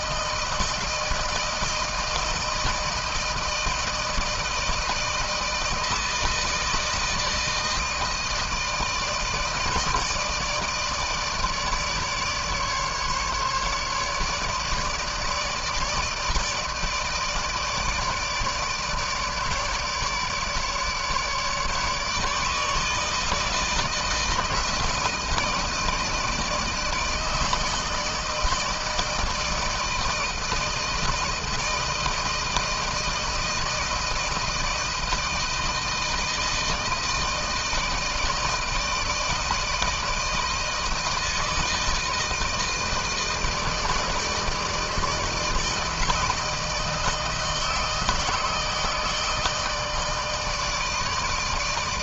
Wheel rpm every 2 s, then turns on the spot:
160, 160, 160, 160, 160, 160, 150, 150, 160, 160, 150, 150, 160, 160, 160, 160, 160, 160, 160, 160, 160, 160, 160, 160, 160, 160.
none